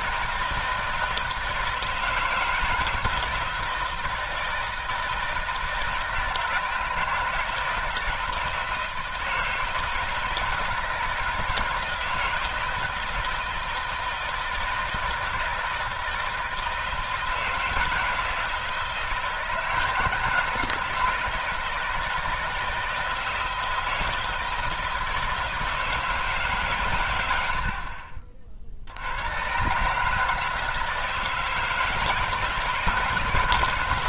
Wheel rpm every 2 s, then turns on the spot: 160, 160, 160, 160, 160, 160, 160, 160, 160, 160, 160, 160, 160, 150, 40, 150, 160.
none